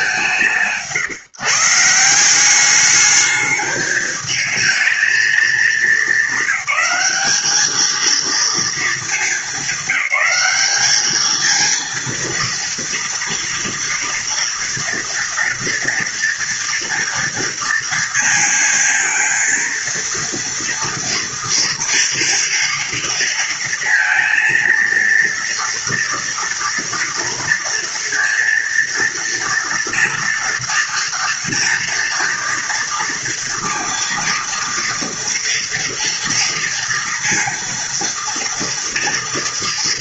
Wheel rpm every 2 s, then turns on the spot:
180, 190, 220, 210, 220, 200, 230, 230, 240, 230, 230, 240, 230, 230, 230, 230, 230, 230, 230, 230.
none